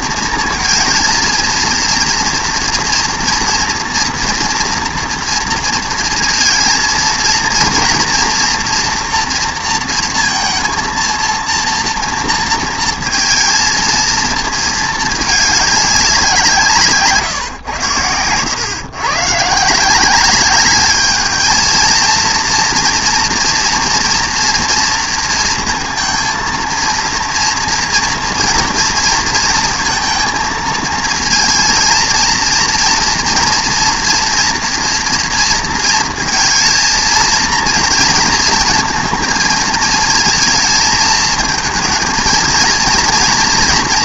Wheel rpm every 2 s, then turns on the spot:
230, 230, 240, 230, 230, 230, 230, 220, 150, 120, 200, 230, 230, 230, 230, 230, 230, 230, 220, 220, 220, 230.
none